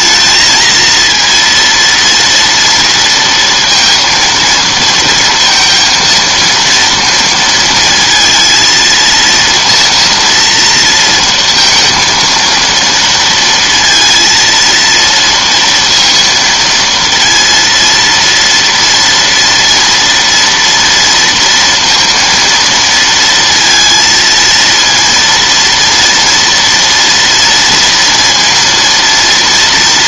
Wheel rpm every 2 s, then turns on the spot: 220, 230, 230, 230, 230, 230, 230, 230, 230, 230, 230, 230, 230, 230, 230.
none